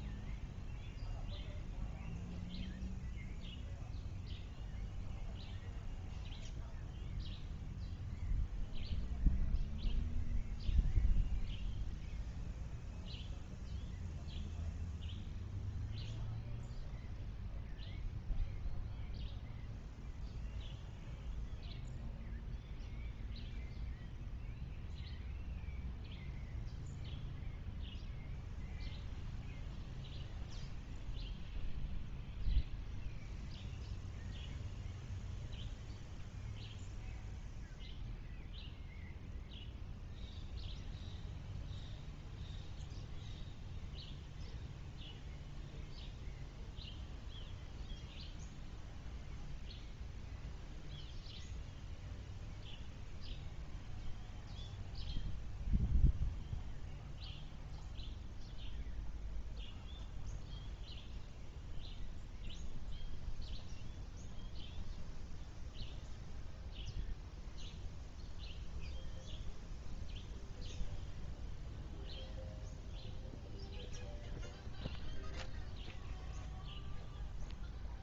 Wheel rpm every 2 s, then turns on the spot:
0, 0, 0, 0, 0, 0, 0, 0, 0, 0, 0, 0, 0, 0, 0, 0, 0, 0, 0, 0, 0, 0, 0, 0, 0, 0, 0, 0, 0, 0, 0, 0, 0, 0, 0, 0, 0, 0, 0.
none